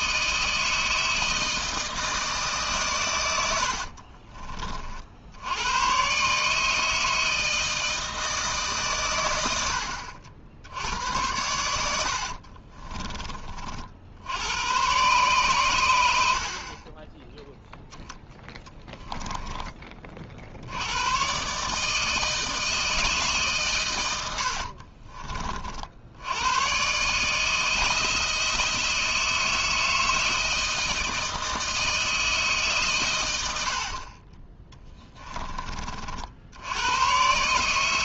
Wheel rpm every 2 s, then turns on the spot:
160, 140, 40, 150, 150, 80, 30, 100, 40, 20, 80, 160, 60, 120, 160, 160, 140, 10, 90.
12-14 18-20 24-26 34-36